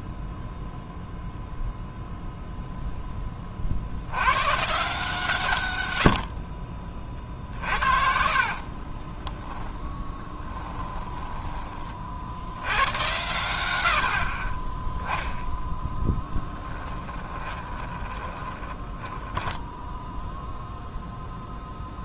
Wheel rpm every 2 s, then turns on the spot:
0, 0, 140, 50, 40, 10, 90, 10, 10, 10, 0.
6-12 16-20